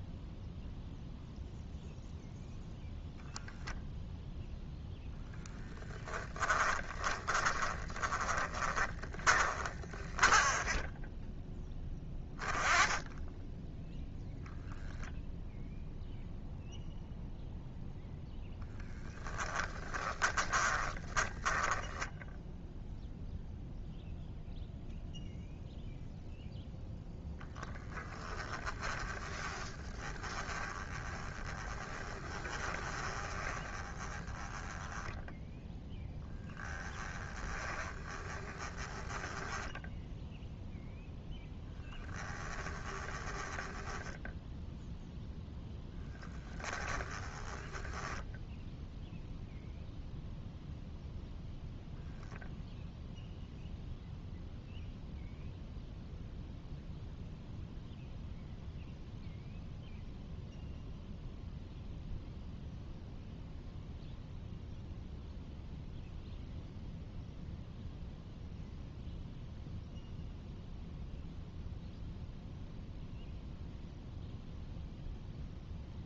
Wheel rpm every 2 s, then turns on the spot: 0, 0, 20, 20, 20, 10, 10, 0, 0, 10, 20, 0, 0, 0, 10, 30, 20, 20, 10, 10, 0, 10, 0, 10, 0, 0, 0, 0, 0, 0, 0, 0, 0, 0, 0, 0, 0, 0.
6-10 20-22 28-40 42-44 46-48